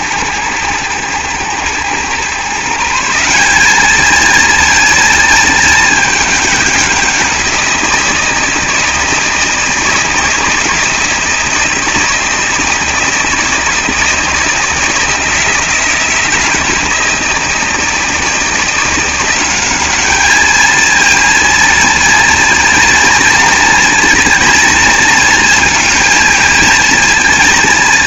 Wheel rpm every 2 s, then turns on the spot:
110, 150, 230, 200, 160, 160, 160, 160, 160, 170, 220, 230, 230, 230.
none